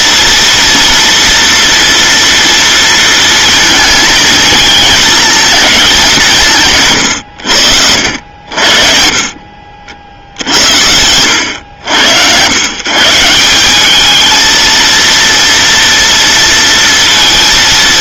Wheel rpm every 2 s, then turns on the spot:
230, 230, 220, 160, 50, 80, 130, 230, 230.
none